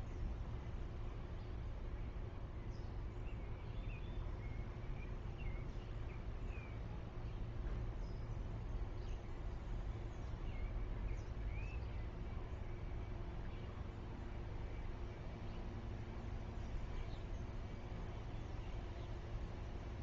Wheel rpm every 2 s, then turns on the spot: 0, 0, 0, 0, 0, 0, 0, 0, 0, 0.
none